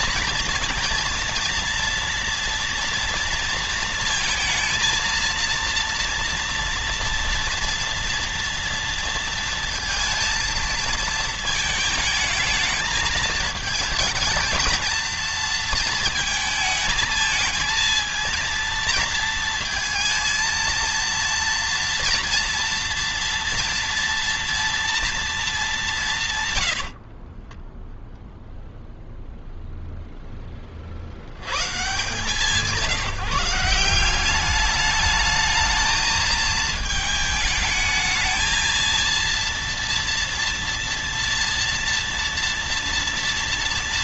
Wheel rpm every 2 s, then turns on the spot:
230, 230, 230, 230, 230, 230, 220, 230, 220, 230, 230, 230, 230, 80, 0, 50, 170, 210, 220, 230, 230, 230.
26-28